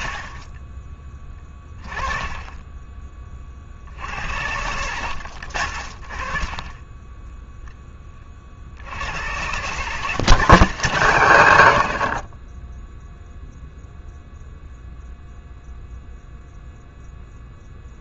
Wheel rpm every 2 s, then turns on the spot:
30, 20, 80, 20, 70, 140, 10, 0, 0.
0-4